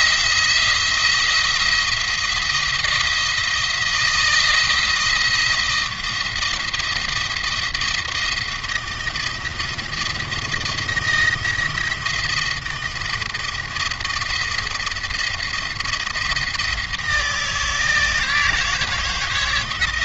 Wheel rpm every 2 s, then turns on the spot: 170, 170, 170, 170, 170, 170, 160, 170, 160, 160.
none